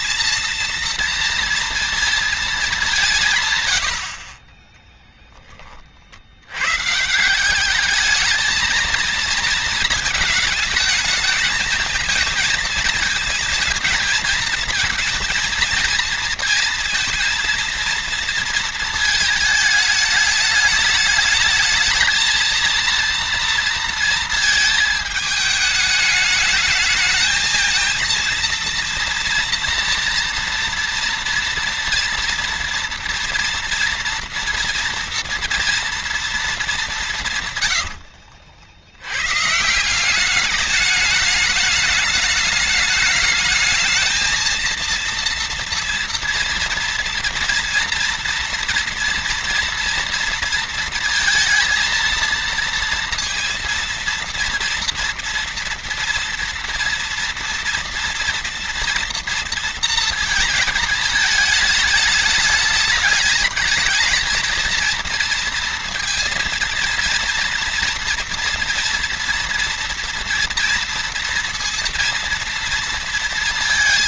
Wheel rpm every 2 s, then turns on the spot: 230, 180, 10, 140, 220, 220, 220, 220, 230, 220, 220, 230, 220, 220, 230, 230, 230, 230, 180, 90, 210, 210, 230, 230, 230, 230, 230, 230, 240, 230, 220, 210, 230, 230, 230, 230, 230.
4-6